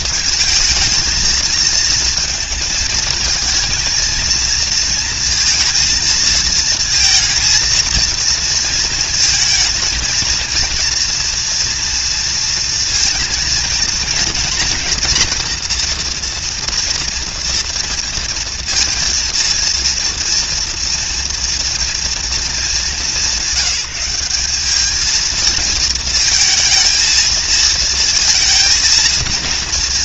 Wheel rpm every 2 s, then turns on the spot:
220, 230, 230, 230, 230, 240, 230, 230, 230, 230, 230, 190, 220, 220, 230.
none